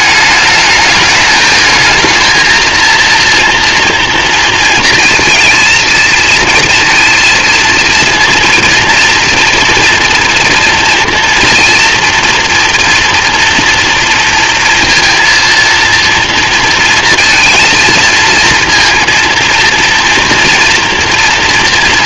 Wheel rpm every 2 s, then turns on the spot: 210, 230, 230, 230, 230, 230, 240, 230, 230, 230, 230.
none